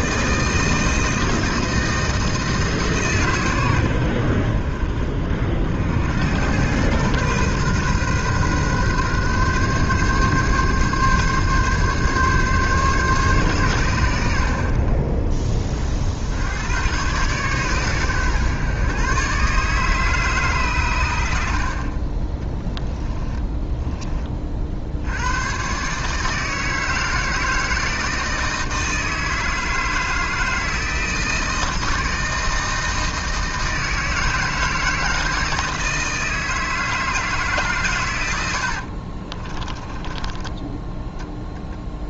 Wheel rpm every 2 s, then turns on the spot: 160, 150, 60, 110, 130, 140, 140, 50, 110, 130, 120, 20, 60, 160, 160, 160, 160, 160, 160, 60, 10.
22-24 38-42